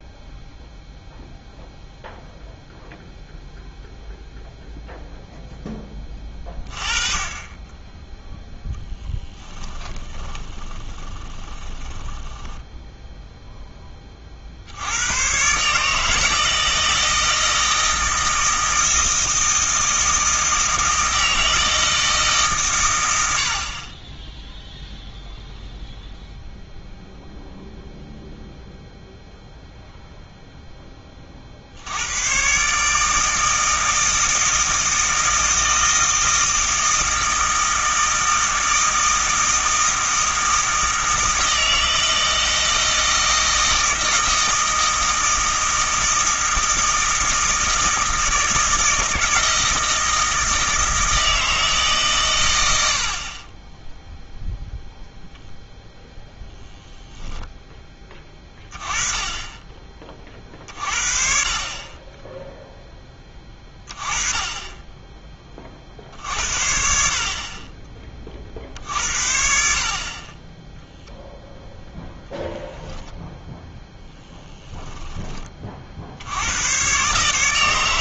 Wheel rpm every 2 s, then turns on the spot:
0, 0, 0, 20, 10, 20, 0, 80, 160, 160, 160, 130, 0, 0, 0, 10, 140, 160, 160, 160, 160, 160, 160, 160, 160, 160, 80, 0, 10, 20, 50, 10, 20, 60, 60, 10, 0, 10, 120.
8-12